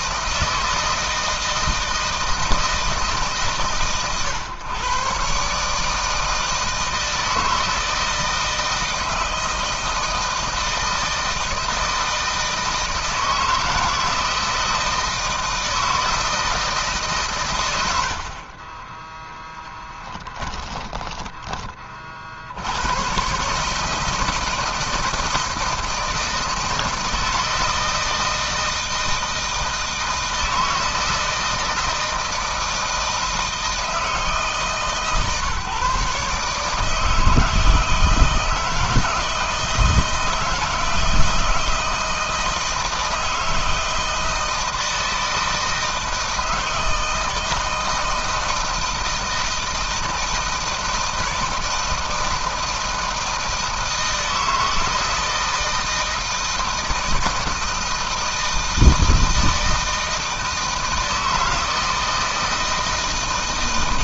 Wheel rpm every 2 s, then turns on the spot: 160, 160, 120, 160, 160, 160, 160, 160, 160, 40, 10, 70, 160, 160, 160, 160, 160, 150, 150, 160, 160, 160, 160, 160, 160, 170, 160, 160, 160, 160, 160, 160.
18-22